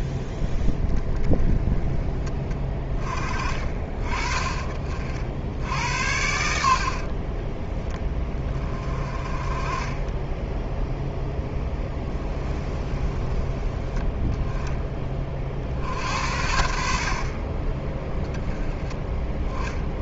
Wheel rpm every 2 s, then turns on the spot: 10, 20, 40, 60, 30, 0, 20, 20, 60, 10.
6-8 12-14